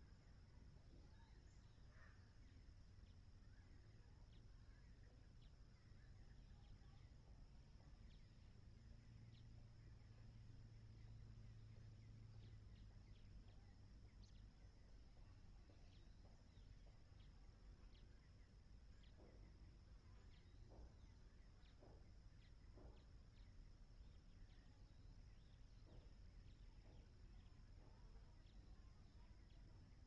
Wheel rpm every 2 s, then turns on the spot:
0, 0, 0, 0, 0, 0, 0, 0, 0, 0, 0, 0, 0, 0, 0.
none